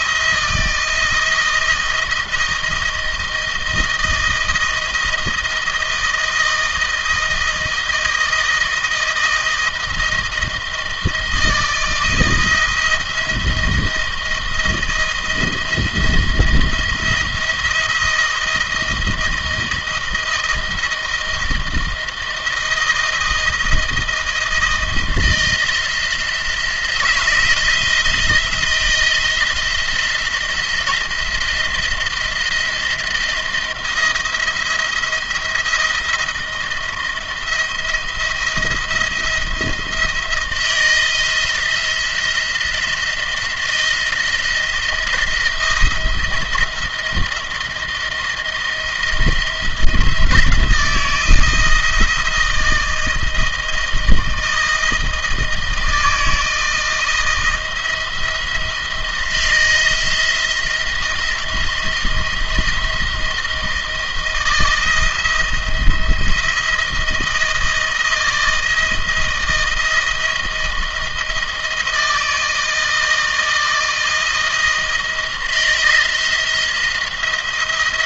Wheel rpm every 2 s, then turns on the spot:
160, 160, 160, 170, 160, 160, 170, 170, 170, 170, 170, 160, 160, 170, 170, 170, 170, 170, 170, 160, 160, 160, 170, 170, 170, 160, 160, 160, 160, 170, 160, 170, 170, 170, 160, 160, 160, 170, 170.
none